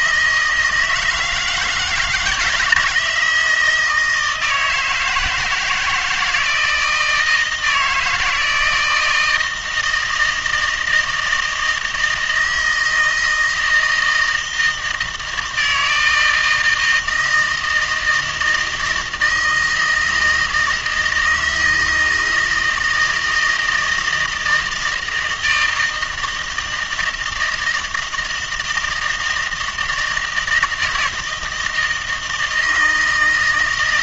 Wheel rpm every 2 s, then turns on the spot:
160, 170, 160, 160, 160, 160, 160, 160, 160, 160, 160, 160, 160, 160, 160, 160, 160.
none